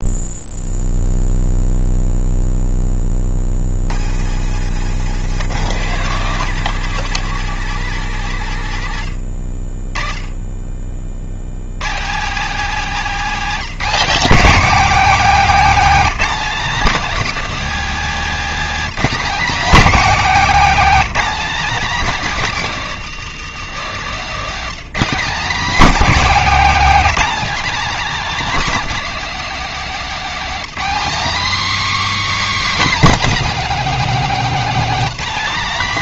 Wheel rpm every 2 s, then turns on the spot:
0, 10, 110, 170, 110, 30, 230, 250, 250, 250, 250, 220, 220, 260, 270, 260, 290, 260.
4-6